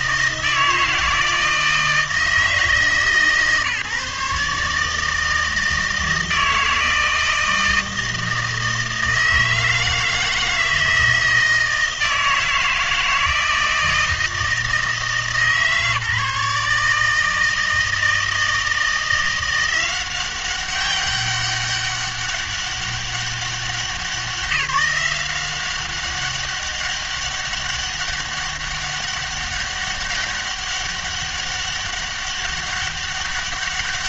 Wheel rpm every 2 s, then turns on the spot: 160, 150, 150, 160, 160, 160, 160, 160, 150, 160, 190, 200, 180, 200, 200, 200, 200.
none